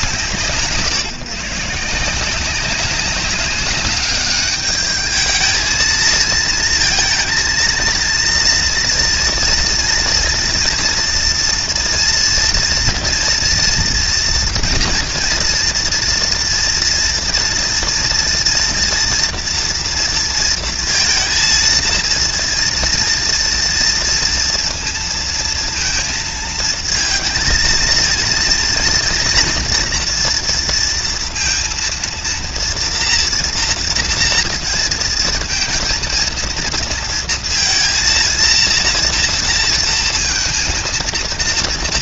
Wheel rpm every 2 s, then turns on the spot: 160, 180, 210, 230, 240, 230, 230, 230, 230, 240, 230, 230, 230, 230, 230, 230, 230, 230, 230, 230, 230.
none